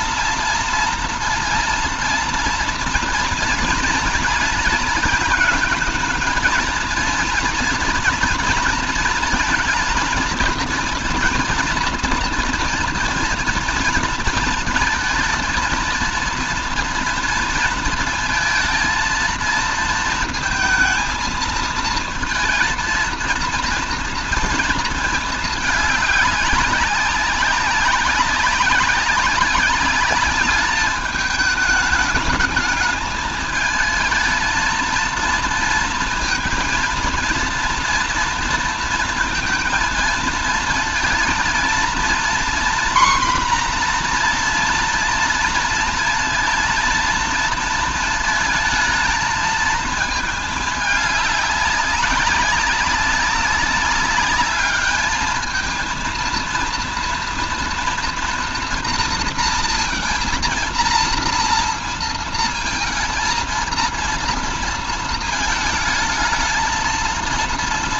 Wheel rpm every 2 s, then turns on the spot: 230, 230, 230, 220, 230, 230, 230, 230, 230, 230, 230, 220, 230, 200, 200, 210, 210, 220, 230, 230, 230, 240, 240, 230, 220, 220, 200, 210, 230, 240, 230, 230, 230, 220.
none